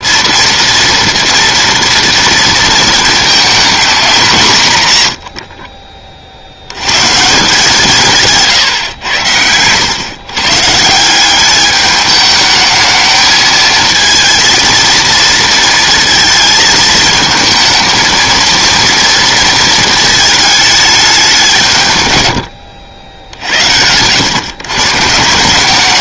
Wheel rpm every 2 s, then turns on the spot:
230, 220, 150, 90, 140, 140, 220, 230, 220, 230, 220, 100, 130.
22-24